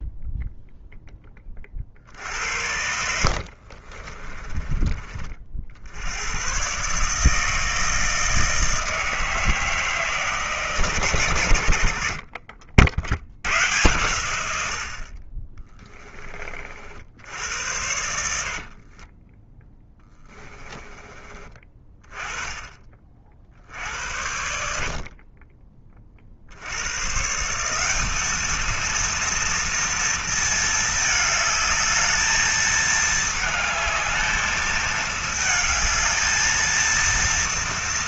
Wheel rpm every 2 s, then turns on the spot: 10, 60, 30, 140, 160, 130, 70, 60, 60, 30, 20, 40, 60, 110, 230, 220, 220, 220, 230.
2-4 18-22